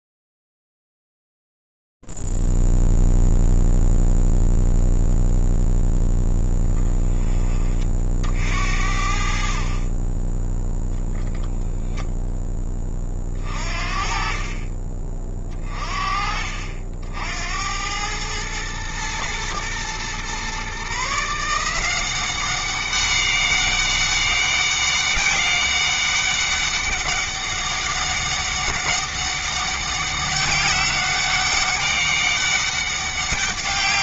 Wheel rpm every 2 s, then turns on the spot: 0, 0, 0, 0, 50, 10, 20, 40, 50, 110, 150, 200, 200, 200, 200, 200, 200.
none